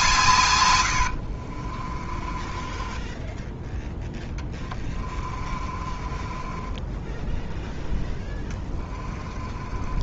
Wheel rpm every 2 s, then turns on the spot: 130, 20, 10, 20, 20.
0-10